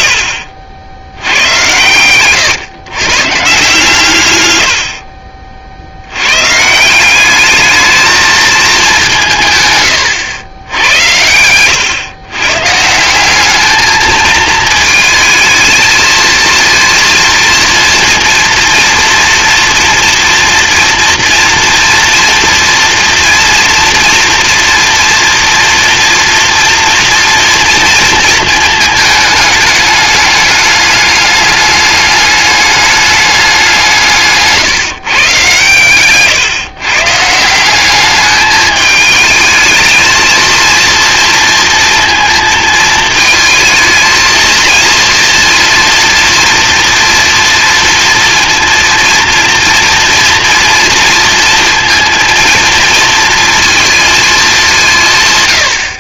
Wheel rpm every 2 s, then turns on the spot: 80, 120, 100, 150, 220, 100, 150, 220, 230, 230, 230, 230, 240, 230, 220, 210, 200, 150, 140, 210, 230, 220, 230, 230, 230, 230, 230, 180.
none